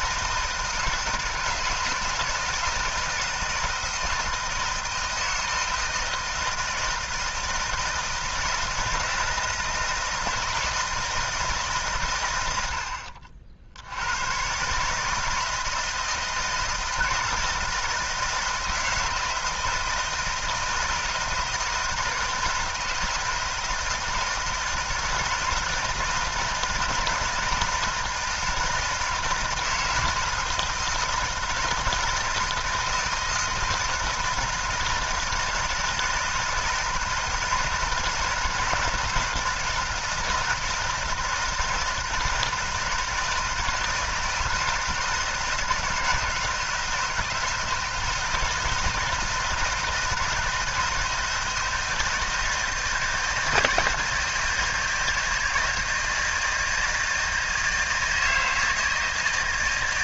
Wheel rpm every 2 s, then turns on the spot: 160, 170, 160, 160, 160, 160, 70, 140, 160, 160, 160, 160, 160, 160, 160, 160, 160, 160, 160, 160, 160, 160, 160, 160, 160, 160, 160, 160, 160, 160.
none